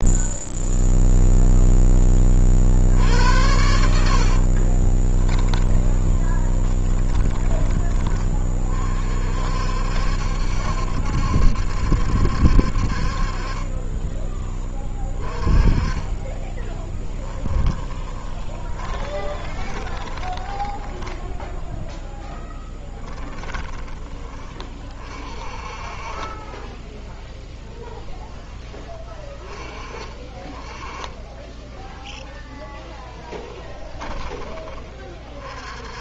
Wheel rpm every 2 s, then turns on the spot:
0, 60, 20, 20, 40, 70, 60, 20, 10, 30, 10, 10, 30, 10, 10, 20, 10, 20.
4-8 16-24 26-28